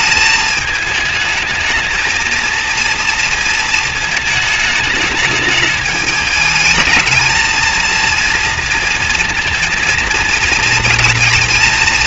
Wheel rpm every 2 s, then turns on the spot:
220, 230, 210, 210, 230, 230.
none